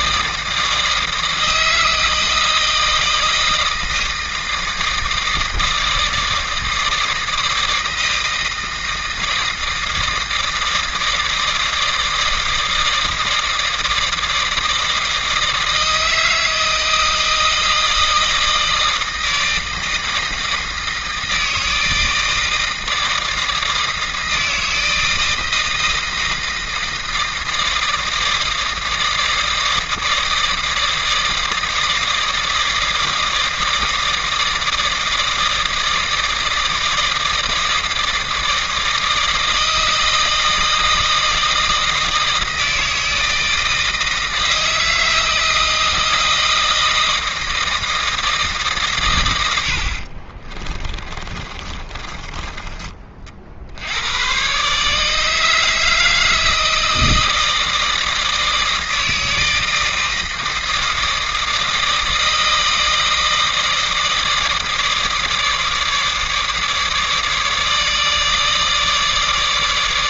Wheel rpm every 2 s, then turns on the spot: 160, 160, 160, 160, 160, 160, 160, 160, 160, 160, 160, 160, 160, 160, 160, 160, 160, 160, 160, 160, 160, 160, 160, 160, 150, 30, 30, 140, 160, 160, 160, 160, 160, 150, 150.
50-52